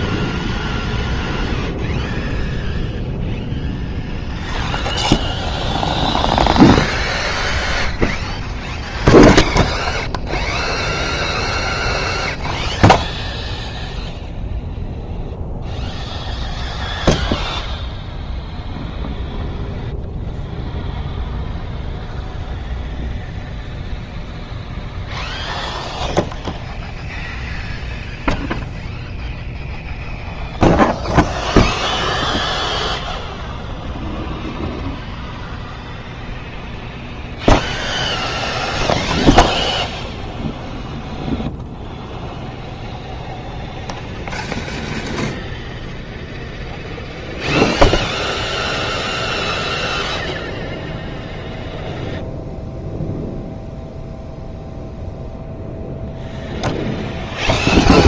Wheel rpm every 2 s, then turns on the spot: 0, 0, 0, 0, 0, 0, 0, 0, 0, 0, 0, 0, 0, 0, 0, 0, 0, 0, 0, 0, 0, 10, 50, 0, 0, 0, 0, 0, 0.
none